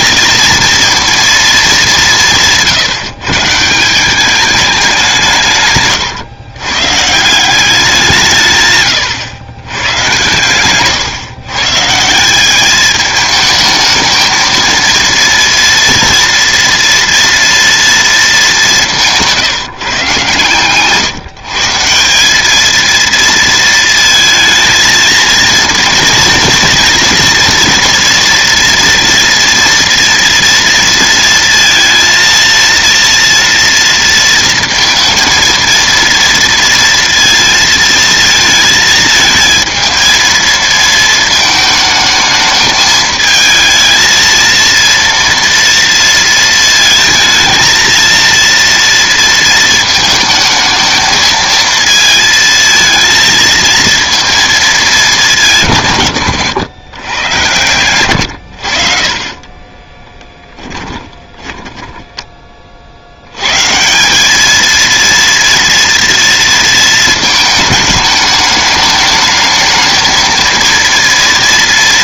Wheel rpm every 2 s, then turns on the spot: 230, 160, 200, 120, 150, 120, 200, 230, 230, 190, 130, 210, 230, 230, 240, 230, 230, 230, 230, 230, 220, 220, 230, 220, 230, 220, 230, 230, 110, 70, 20, 30, 220, 230, 210, 230.
10-12 60-62